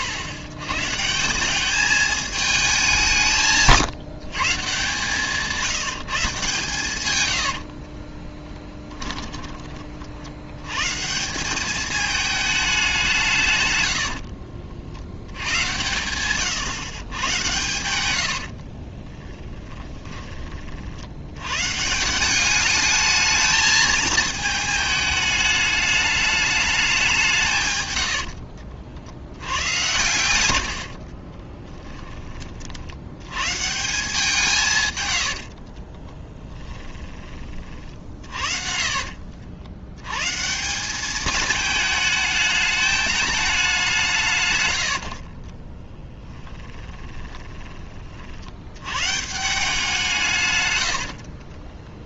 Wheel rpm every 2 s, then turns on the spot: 120, 190, 150, 140, 20, 120, 200, 60, 130, 50, 50, 210, 220, 210, 60, 90, 50, 140, 20, 50, 180, 210, 90, 20, 110, 130.
8-10 18-20 30-32 36-40 44-48 50-52